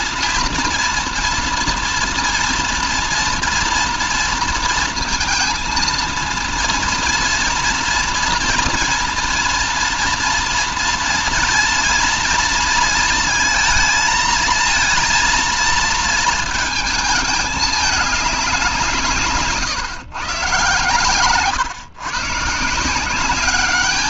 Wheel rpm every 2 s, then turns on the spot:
230, 230, 230, 230, 230, 230, 230, 230, 220, 180, 130, 170.
none